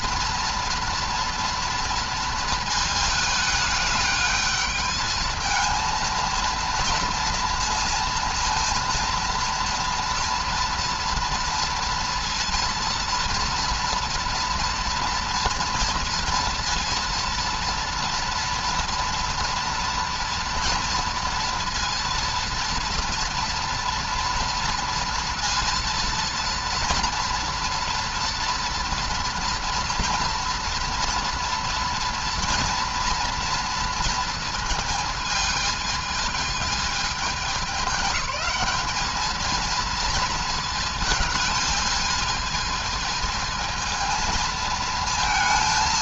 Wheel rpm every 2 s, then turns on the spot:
230, 220, 210, 230, 230, 230, 230, 230, 230, 230, 230, 230, 230, 230, 230, 230, 230, 220, 210, 200, 220, 220, 230.
none